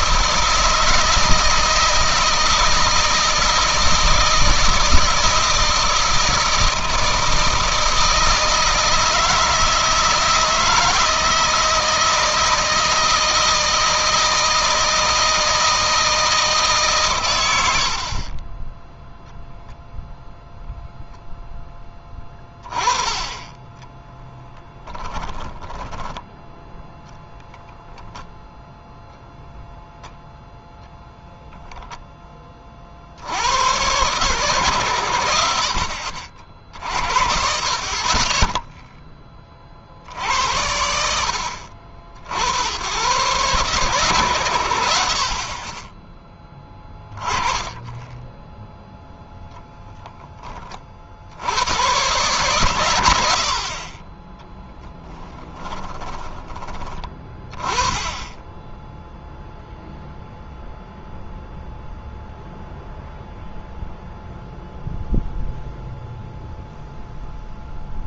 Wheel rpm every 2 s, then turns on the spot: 160, 160, 160, 160, 160, 160, 160, 160, 140, 10, 0, 20, 10, 0, 0, 0, 50, 110, 60, 10, 70, 100, 70, 20, 0, 50, 100, 10, 20, 0, 0, 0, 0, 0.
24-26 54-56